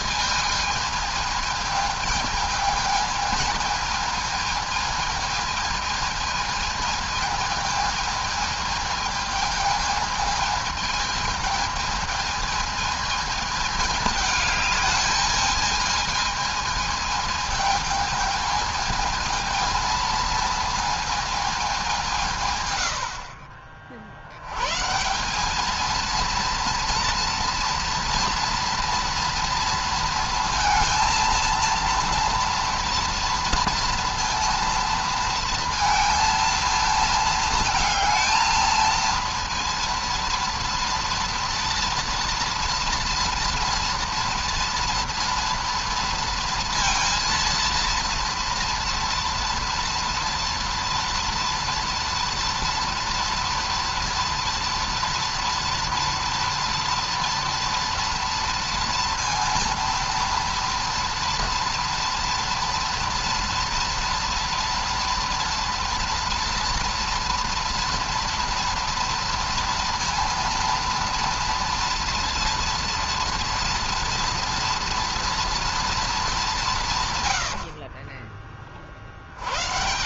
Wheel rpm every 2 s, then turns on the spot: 220, 220, 220, 220, 220, 220, 220, 210, 220, 220, 220, 110, 140, 230, 230, 230, 230, 230, 220, 230, 230, 230, 230, 230, 230, 230, 230, 230, 230, 230, 230, 230, 240, 230, 230, 230, 230, 230, 160, 30.
none